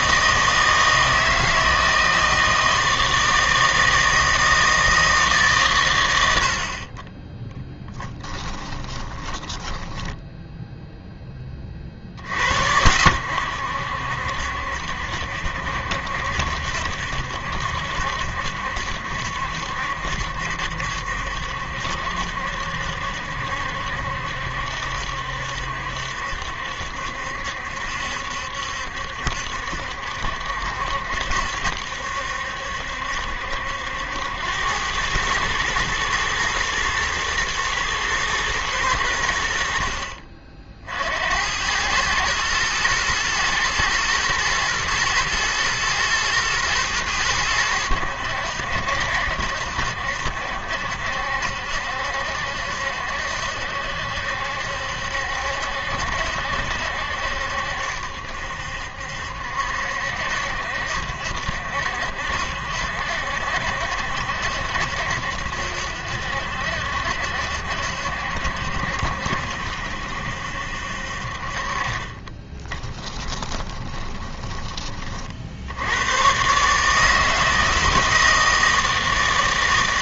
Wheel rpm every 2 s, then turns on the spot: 160, 160, 160, 50, 20, 0, 70, 70, 70, 70, 70, 70, 70, 70, 70, 70, 70, 90, 110, 110, 50, 110, 120, 110, 80, 70, 70, 70, 70, 70, 70, 70, 70, 60, 70, 70, 20, 20, 140, 160.
8-10 72-74